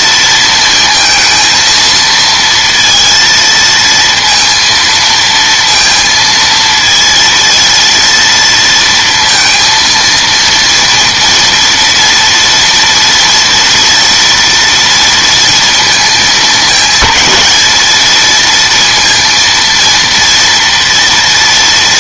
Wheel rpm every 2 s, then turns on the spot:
230, 230, 230, 230, 230, 230, 230, 230, 220, 230, 230.
none